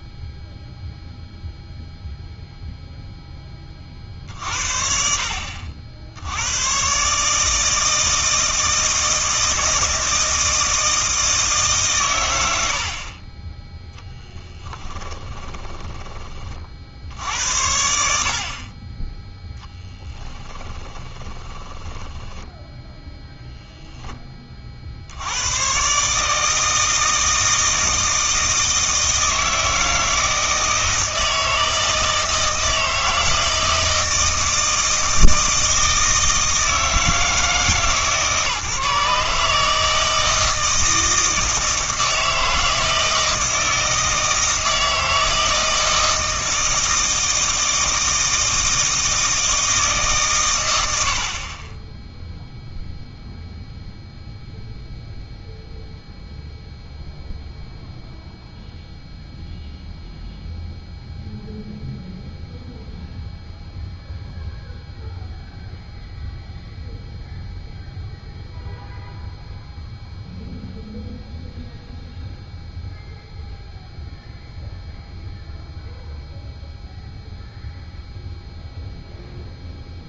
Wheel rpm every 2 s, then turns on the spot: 0, 0, 50, 120, 160, 160, 70, 10, 60, 30, 20, 10, 50, 160, 160, 160, 160, 160, 160, 150, 160, 160, 160, 160, 160, 90, 0, 0, 0, 0, 0, 0, 0, 0, 0, 0, 0, 0, 0, 0.
14-16 20-22